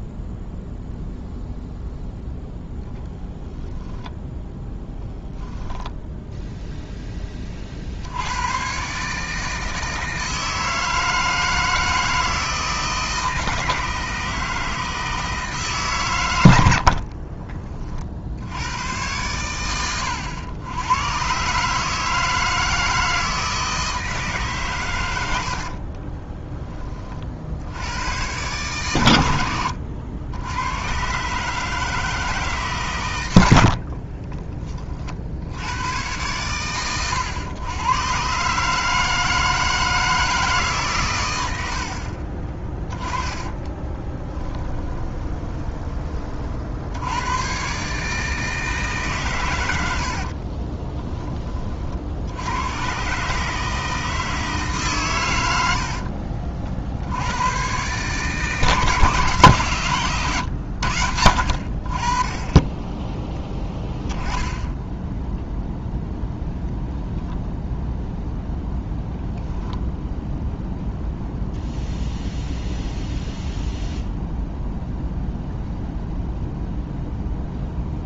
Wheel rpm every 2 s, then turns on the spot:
0, 10, 10, 0, 140, 160, 160, 160, 60, 110, 110, 160, 120, 30, 120, 120, 120, 40, 110, 150, 130, 10, 20, 80, 150, 20, 120, 130, 70, 160, 80, 10, 10, 0, 0, 0, 0, 0, 0.
4-6 16-18 42-46 50-52 60-62